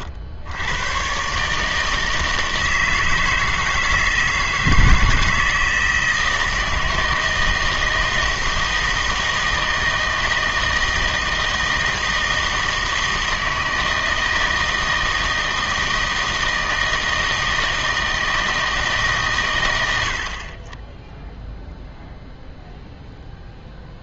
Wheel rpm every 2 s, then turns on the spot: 80, 160, 160, 160, 160, 160, 160, 160, 160, 160, 30, 0.
none